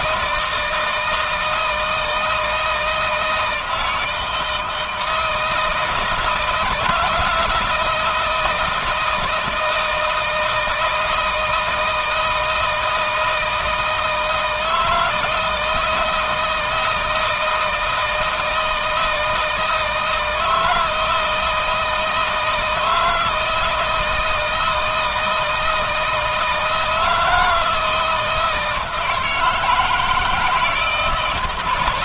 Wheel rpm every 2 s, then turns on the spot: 160, 160, 160, 160, 170, 160, 160, 160, 160, 160, 170, 160, 160, 160, 160, 160.
none